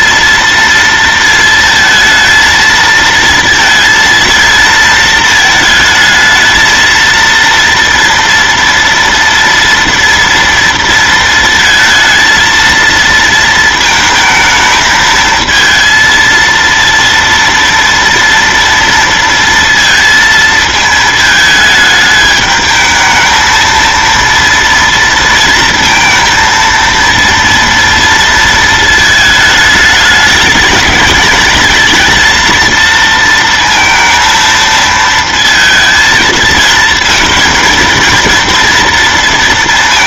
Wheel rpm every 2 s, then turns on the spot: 230, 230, 230, 220, 230, 230, 230, 220, 230, 230, 220, 210, 230, 230, 220, 210, 230, 230, 220, 230.
none